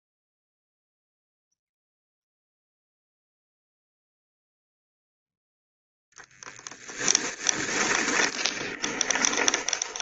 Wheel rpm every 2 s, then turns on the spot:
0, 0, 0, 10, 20.
6-10